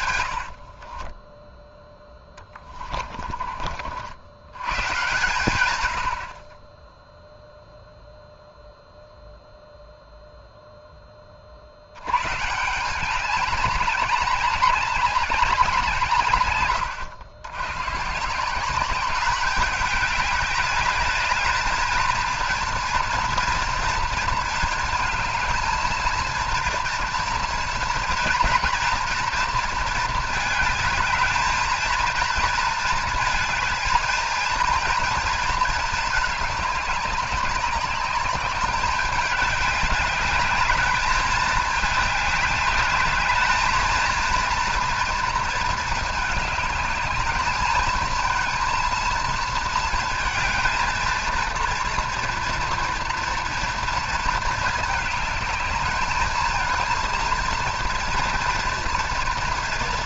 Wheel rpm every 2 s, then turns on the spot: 50, 30, 120, 20, 0, 0, 170, 200, 110, 180, 200, 230, 220, 230, 230, 220, 230, 230, 200, 200, 210, 210, 230, 210, 230, 220, 230, 210, 220, 230.
0-4 16-18